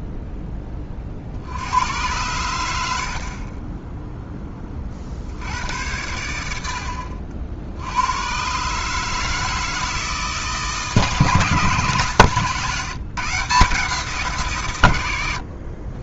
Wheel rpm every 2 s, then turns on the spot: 30, 100, 20, 70, 130, 150, 150, 120.
none